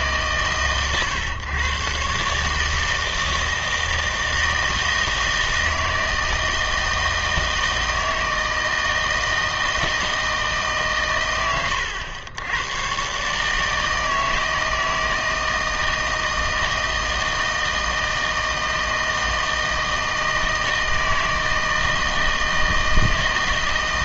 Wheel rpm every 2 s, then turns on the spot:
130, 150, 160, 160, 160, 140, 110, 160, 160, 160, 160, 160.
none